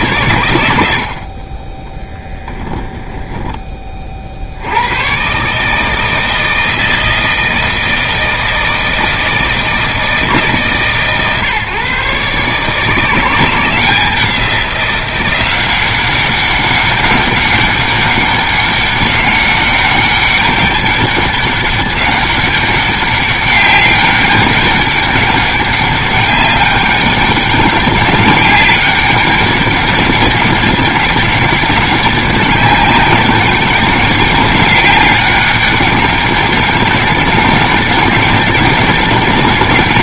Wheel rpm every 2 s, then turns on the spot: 80, 10, 100, 160, 160, 140, 160, 180, 200, 200, 200, 200, 200, 200, 200, 200, 200, 200, 200, 200.
0-4